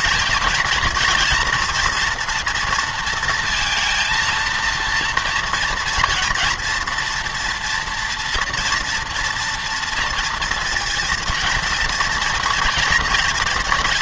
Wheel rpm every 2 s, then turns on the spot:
230, 230, 230, 230, 230, 230, 240.
none